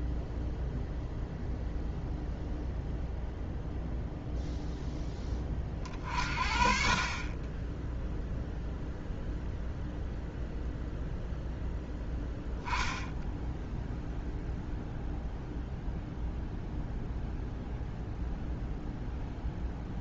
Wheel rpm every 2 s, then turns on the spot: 0, 0, 0, 40, 0, 0, 0, 0, 0, 0.
none